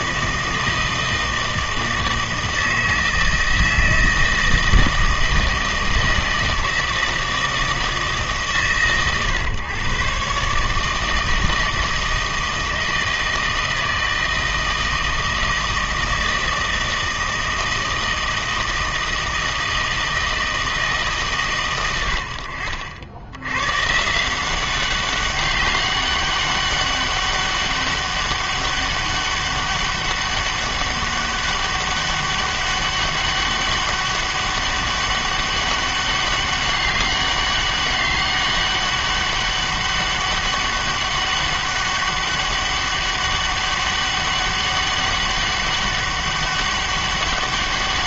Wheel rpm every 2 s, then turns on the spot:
160, 160, 160, 160, 130, 150, 160, 160, 160, 160, 160, 60, 190, 200, 200, 200, 200, 200, 200, 200, 200, 200, 200, 200.
none